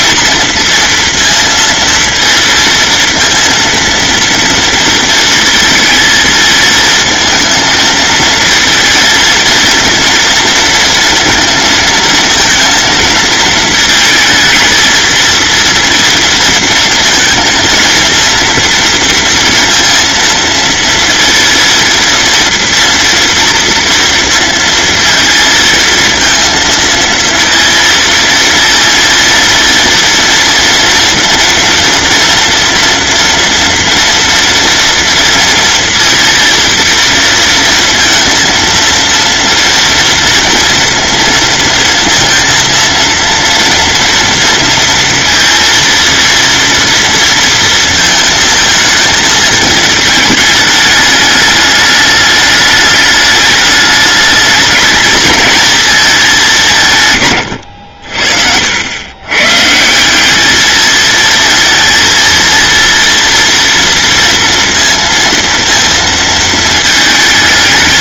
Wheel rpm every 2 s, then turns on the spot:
230, 230, 230, 220, 230, 230, 230, 220, 230, 230, 230, 230, 230, 230, 230, 230, 230, 230, 230, 230, 230, 230, 230, 230, 220, 220, 210, 220, 160, 90, 220, 230, 230, 220.
none